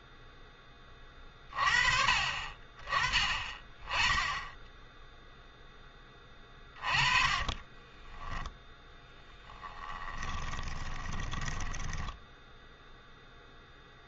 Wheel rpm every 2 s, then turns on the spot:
10, 30, 10, 20, 10, 20, 10.
6-12